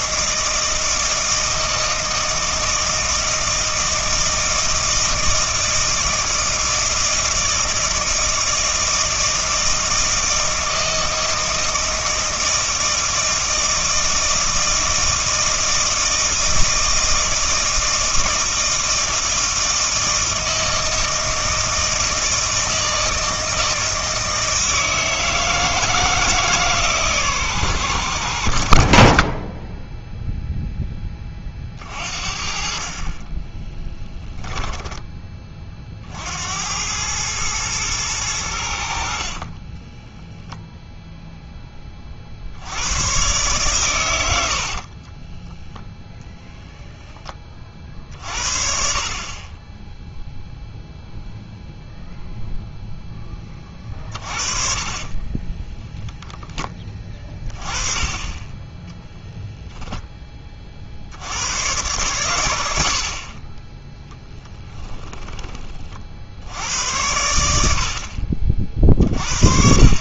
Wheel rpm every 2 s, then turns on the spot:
160, 160, 160, 160, 160, 160, 160, 160, 160, 160, 160, 160, 160, 150, 60, 10, 40, 10, 90, 80, 0, 90, 50, 0, 60, 0, 0, 40, 10, 10, 40, 70, 10, 90, 50.
34-36 44-46 54-56 64-66